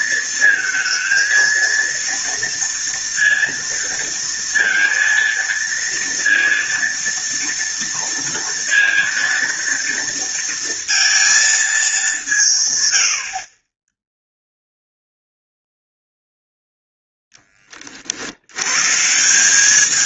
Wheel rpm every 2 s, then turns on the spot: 220, 230, 230, 230, 230, 230, 90, 0, 0, 150.
none